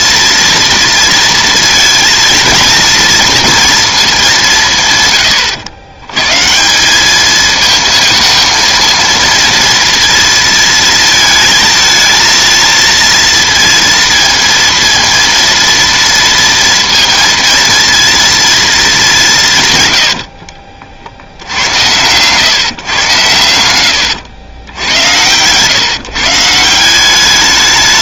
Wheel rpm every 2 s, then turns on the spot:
230, 230, 160, 160, 230, 230, 230, 230, 230, 220, 50, 130, 100, 160.
none